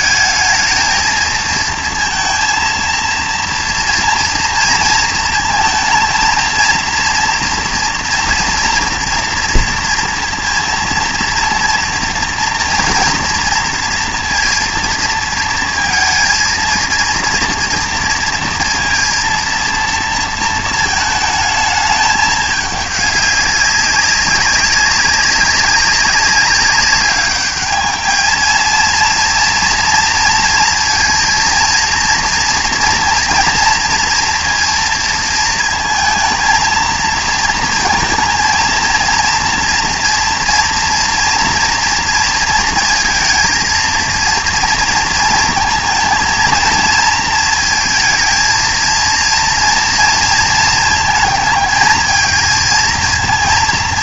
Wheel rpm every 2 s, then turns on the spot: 220, 230, 230, 230, 230, 230, 230, 230, 220, 230, 230, 210, 200, 200, 230, 230, 230, 230, 220, 230, 230, 230, 230, 230, 220, 230, 230.
none